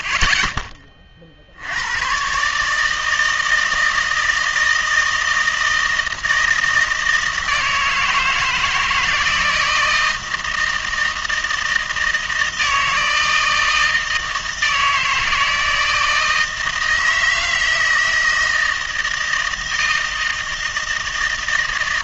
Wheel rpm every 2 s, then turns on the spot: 10, 150, 160, 160, 160, 160, 160, 160, 160, 160, 160.
none